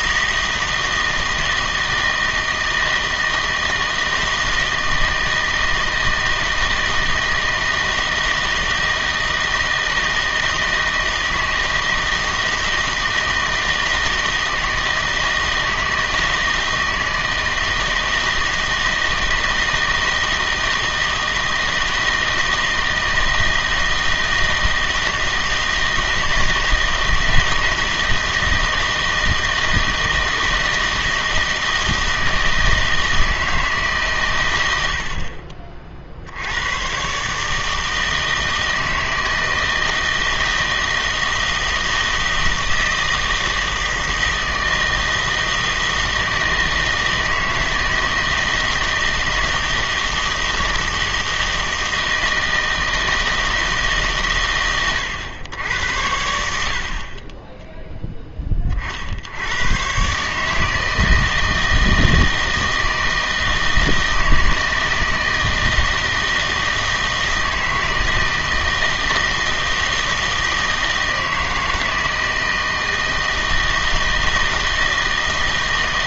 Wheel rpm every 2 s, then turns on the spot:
160, 160, 160, 160, 160, 160, 160, 160, 160, 160, 160, 160, 160, 160, 160, 160, 160, 90, 100, 160, 160, 160, 160, 160, 160, 160, 160, 120, 60, 40, 160, 160, 160, 160, 160, 160, 160, 160.
none